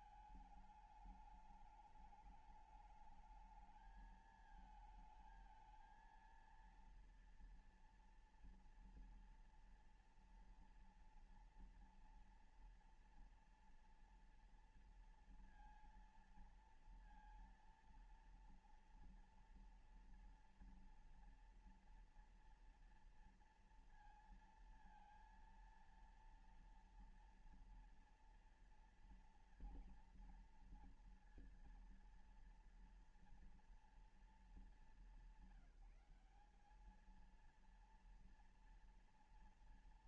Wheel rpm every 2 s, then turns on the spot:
220, 210, 220, 230, 230, 230, 230, 230, 230, 230, 230, 230, 230, 230, 230, 230, 230, 220, 200, 230.
none